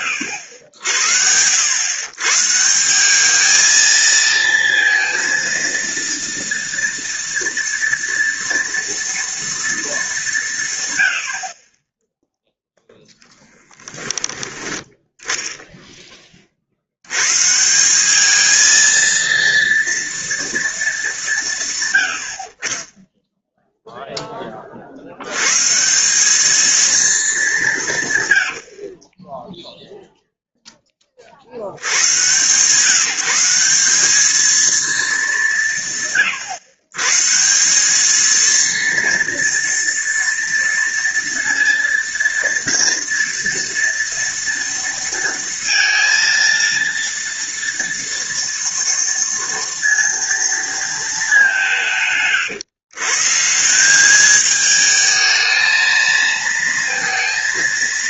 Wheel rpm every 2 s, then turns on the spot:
100, 160, 230, 230, 230, 140, 0, 10, 60, 220, 220, 30, 40, 220, 60, 10, 140, 230, 140, 230, 230, 230, 230, 230, 230, 230, 120, 220, 230.
none